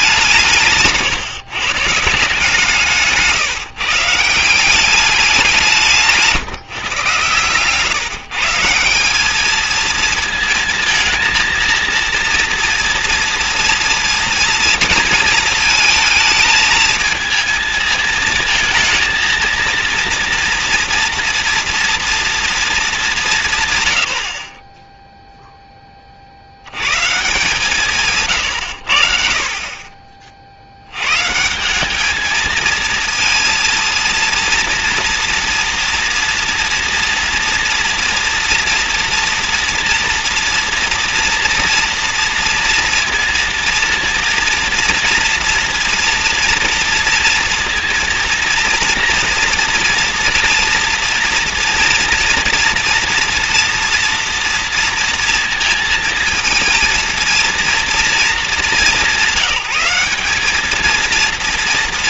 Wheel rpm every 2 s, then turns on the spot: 170, 160, 180, 150, 160, 220, 230, 230, 220, 230, 230, 220, 10, 80, 130, 60, 220, 230, 230, 230, 240, 230, 230, 230, 230, 230, 230, 230, 230, 220, 210.
none